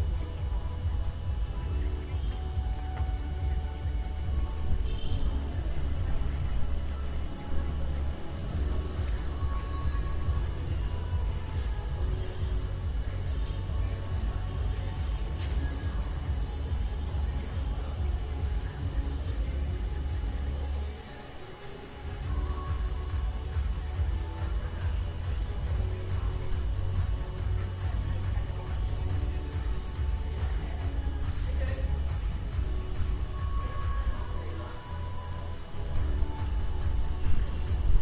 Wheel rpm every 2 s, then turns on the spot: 0, 0, 0, 0, 0, 0, 0, 0, 0, 0, 0, 0, 0, 0, 0, 0, 0, 0, 0.
none